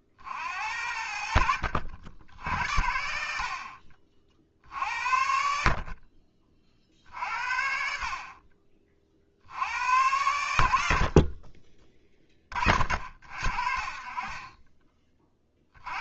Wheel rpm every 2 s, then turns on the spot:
70, 60, 60, 40, 40, 70, 40, 30.
none